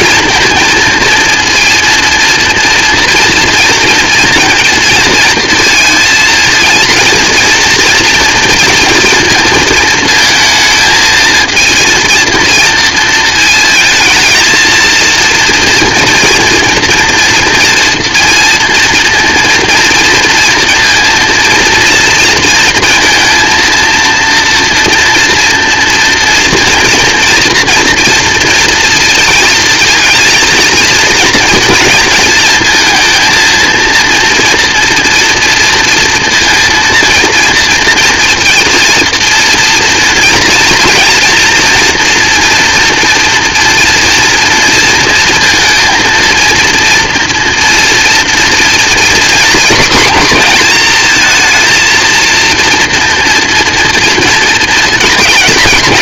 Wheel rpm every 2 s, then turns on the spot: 230, 230, 220, 230, 230, 220, 230, 230, 240, 230, 230, 230, 240, 230, 230, 220, 230, 230, 230, 230, 230, 230, 230, 230, 240, 230, 230, 220.
none